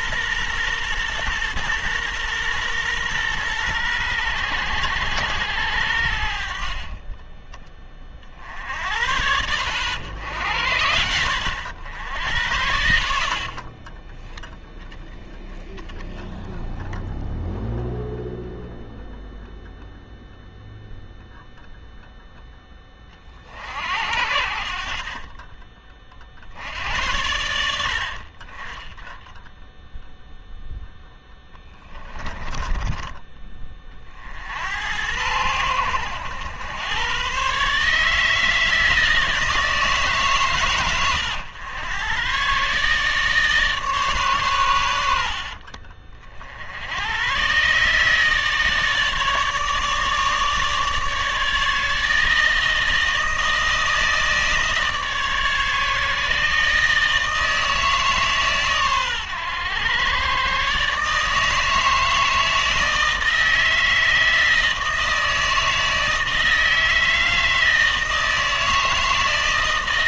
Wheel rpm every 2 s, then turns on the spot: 120, 120, 90, 40, 70, 80, 60, 10, 0, 0, 0, 20, 60, 70, 20, 0, 10, 80, 100, 160, 120, 130, 100, 70, 150, 150, 160, 150, 150, 130, 140, 160, 160, 160, 160.
none